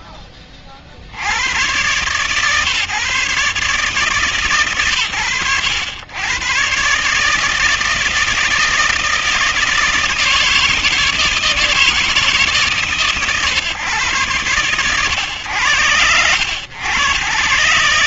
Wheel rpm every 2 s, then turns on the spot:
60, 140, 120, 150, 160, 160, 130, 110, 120.
none